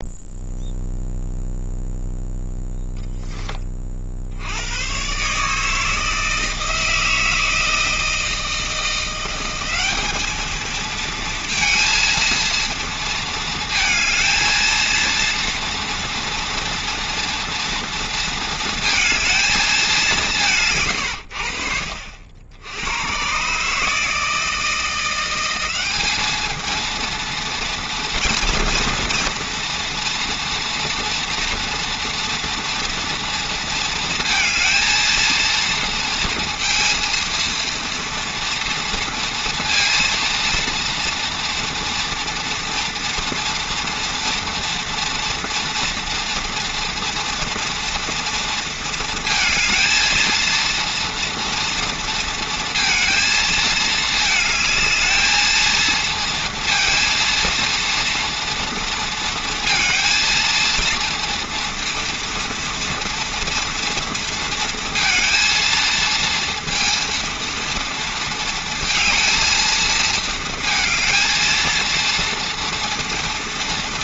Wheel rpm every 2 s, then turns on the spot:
0, 10, 100, 160, 170, 220, 230, 230, 230, 220, 130, 90, 160, 230, 240, 230, 230, 230, 230, 230, 230, 230, 230, 230, 230, 230, 230, 220, 230, 230, 230, 230, 230, 230, 230, 220, 230.
none